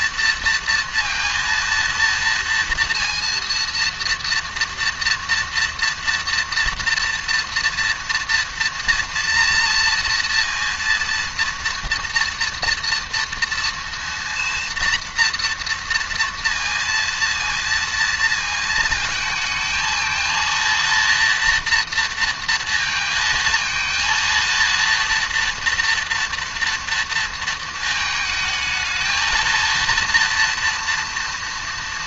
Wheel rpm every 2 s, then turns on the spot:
230, 230, 230, 230, 230, 230, 230, 240, 230, 220, 230, 230, 230, 230, 220, 230.
none